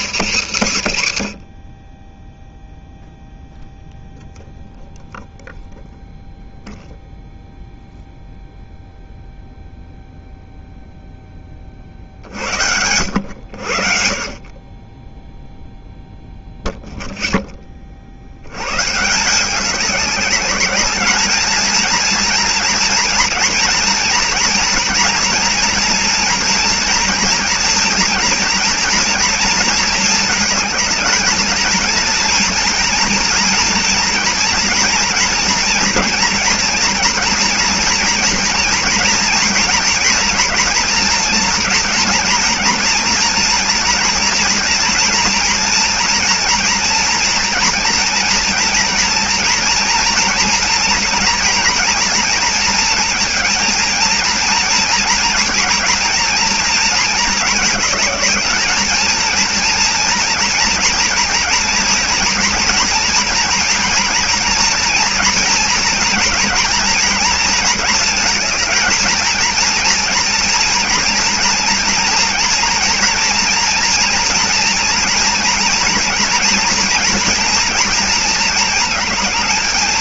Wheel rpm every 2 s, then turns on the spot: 120, 0, 0, 0, 0, 0, 70, 40, 0, 90, 200, 230, 230, 230, 230, 220, 230, 230, 230, 230, 230, 230, 230, 230, 230, 230, 230, 230, 230, 220, 230, 240, 230, 230, 220, 230, 240, 230, 230, 230.
none